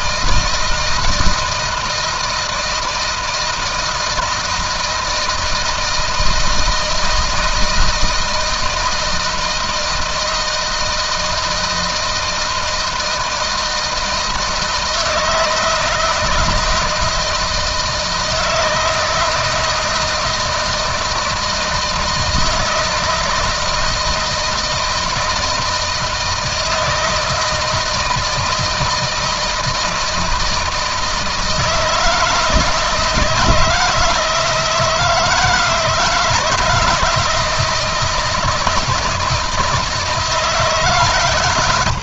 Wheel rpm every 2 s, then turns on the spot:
160, 160, 160, 160, 160, 160, 160, 160, 160, 160, 160, 160, 160, 160, 160, 160, 160, 160, 170, 160, 140.
none